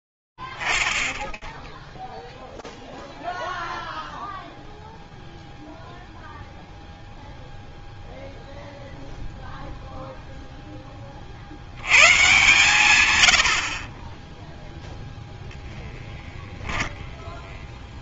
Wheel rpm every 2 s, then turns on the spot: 10, 10, 0, 0, 0, 40, 110, 0, 0.
none